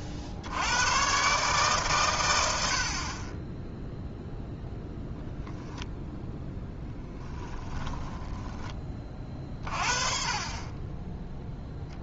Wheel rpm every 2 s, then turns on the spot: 100, 70, 0, 10, 30, 10.
none